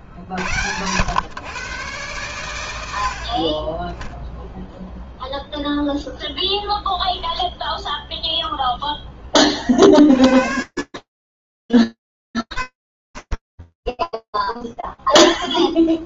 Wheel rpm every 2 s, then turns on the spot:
110, 70, 0, 0, 30, 110, 50, 0.
none